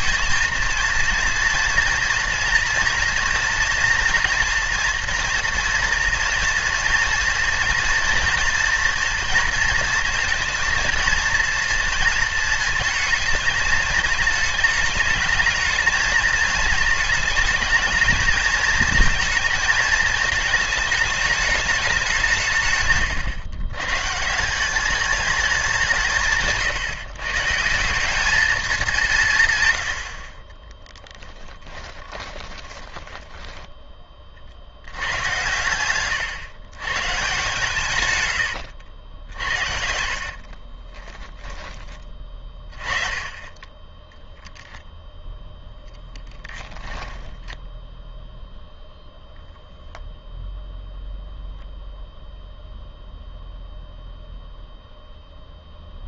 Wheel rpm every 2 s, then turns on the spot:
230, 230, 230, 230, 230, 230, 230, 220, 220, 220, 210, 150, 190, 160, 200, 10, 20, 80, 130, 100, 40, 30, 0, 10, 0, 0, 0, 0.
30-34 38-42 46-48